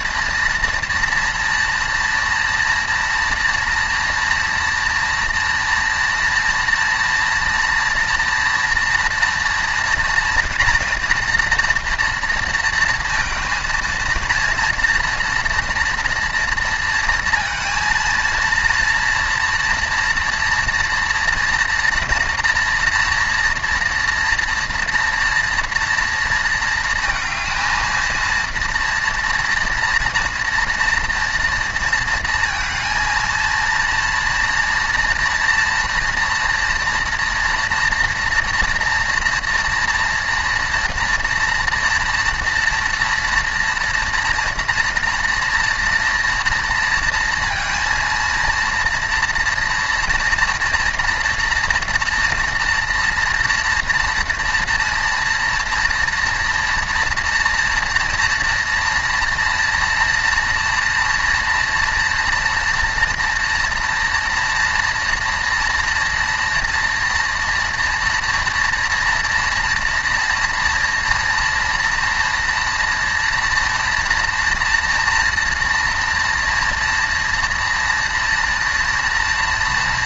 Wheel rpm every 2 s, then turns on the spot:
230, 230, 230, 240, 240, 230, 230, 230, 230, 230, 230, 230, 230, 230, 230, 230, 230, 230, 230, 240, 230, 230, 230, 230, 230, 240, 230, 240, 230, 230, 230, 230, 230, 230, 230, 230, 230, 230, 240, 230.
none